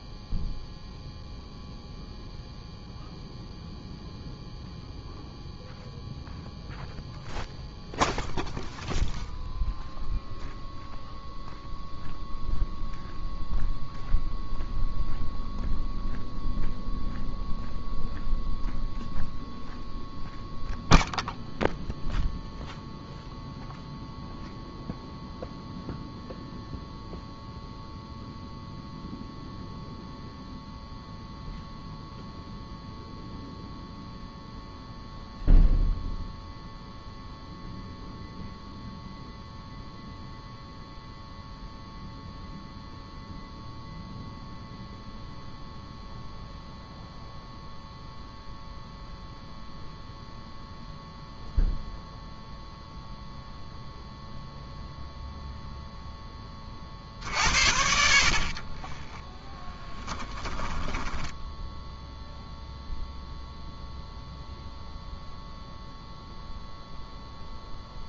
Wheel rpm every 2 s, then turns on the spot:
0, 0, 0, 0, 0, 0, 0, 0, 0, 0, 0, 0, 0, 0, 0, 0, 0, 0, 0, 0, 0, 0, 0, 0, 0, 0, 0, 0, 40, 20, 10, 0, 0, 0.
58-62